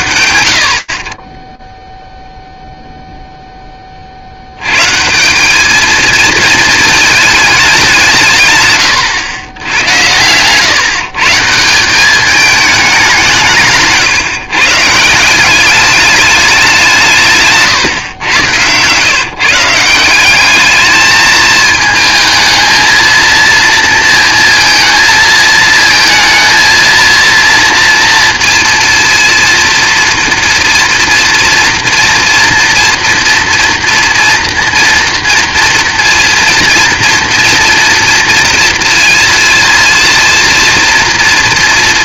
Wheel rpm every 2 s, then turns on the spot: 50, 10, 200, 210, 90, 180, 160, 190, 150, 150, 220, 230, 220, 230, 230, 230, 230, 230, 230, 230, 220.
none